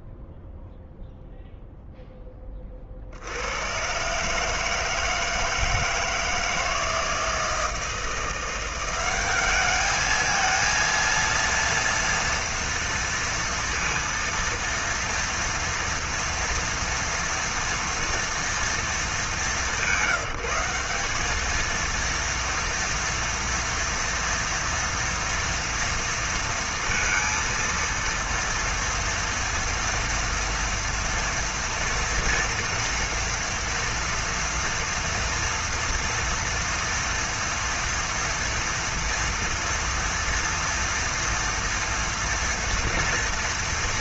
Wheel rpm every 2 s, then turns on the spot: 0, 30, 150, 160, 180, 230, 230, 230, 230, 230, 190, 230, 230, 230, 230, 230, 240, 240, 230, 240, 230, 230.
none